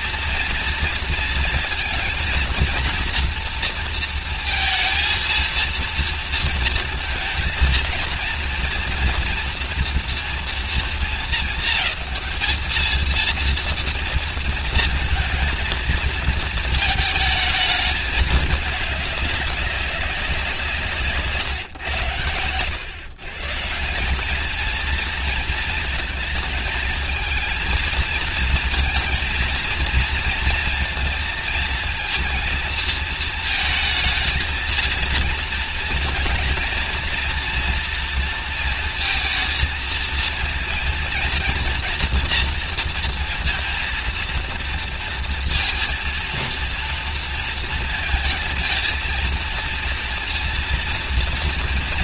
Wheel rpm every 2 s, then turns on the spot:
230, 230, 230, 230, 230, 230, 220, 230, 220, 200, 160, 110, 220, 230, 230, 230, 230, 220, 240, 230, 230, 240, 230, 230, 230, 230.
none